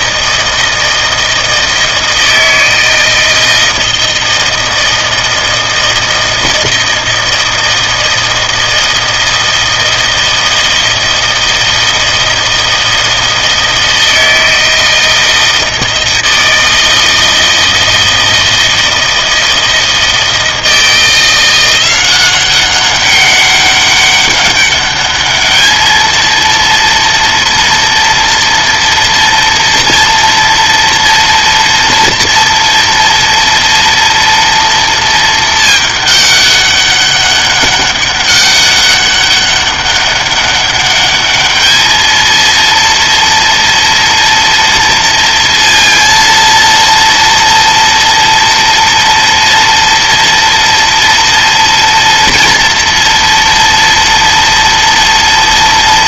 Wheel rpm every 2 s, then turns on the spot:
160, 160, 160, 160, 160, 160, 160, 160, 160, 160, 160, 190, 200, 230, 230, 230, 230, 230, 200, 200, 200, 230, 230, 230, 230, 230, 230, 230.
none